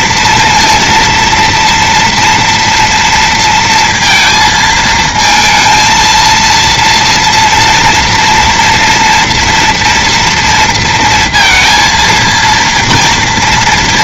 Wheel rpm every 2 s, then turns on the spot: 230, 230, 230, 230, 240, 230, 230.
none